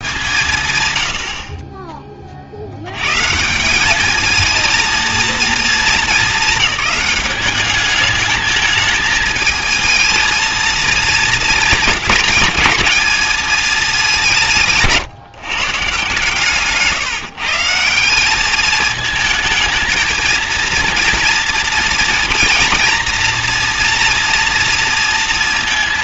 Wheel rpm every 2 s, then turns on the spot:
140, 60, 220, 210, 220, 220, 220, 160, 150, 200, 230, 230, 230.
16-18